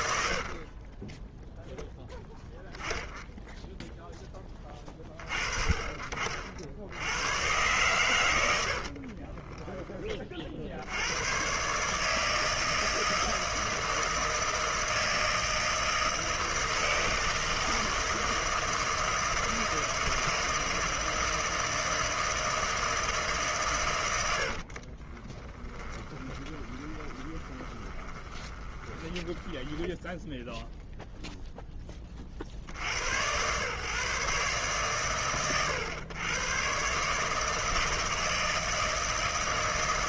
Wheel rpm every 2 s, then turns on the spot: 60, 0, 10, 60, 90, 40, 160, 160, 160, 160, 160, 160, 80, 20, 20, 0, 50, 140, 130, 160.
0-2 8-10 24-30